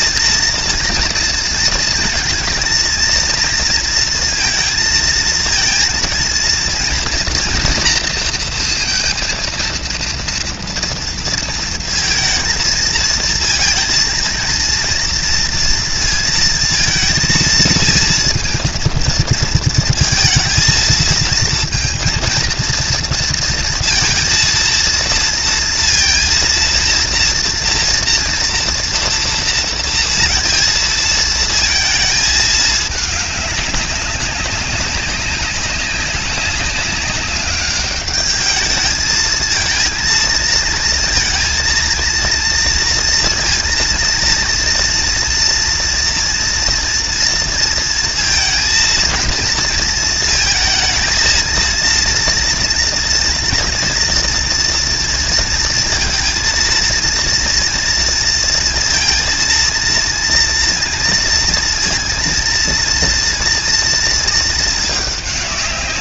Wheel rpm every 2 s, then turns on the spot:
230, 230, 230, 230, 230, 230, 220, 230, 230, 230, 230, 230, 230, 230, 230, 230, 210, 200, 190, 210, 230, 230, 230, 230, 230, 220, 230, 240, 230, 230, 230, 230, 220.
none